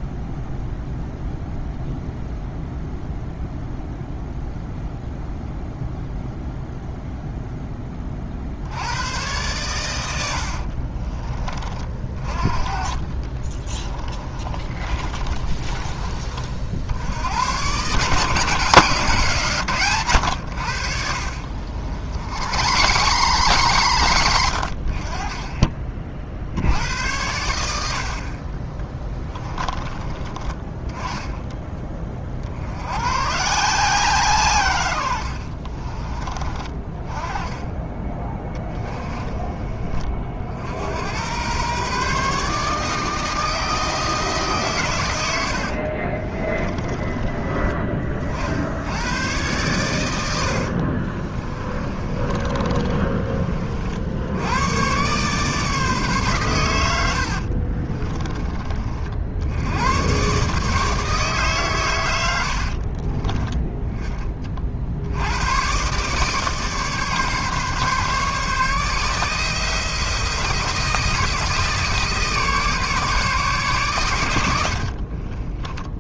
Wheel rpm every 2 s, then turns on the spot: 0, 0, 0, 0, 90, 40, 40, 30, 70, 160, 60, 130, 50, 80, 20, 20, 110, 100, 30, 20, 90, 160, 110, 20, 90, 40, 30, 120, 80, 50, 150, 40, 70, 150, 150, 170, 150, 50.
10-16 20-24 28-32 38-40 46-48 50-54 62-64 74-76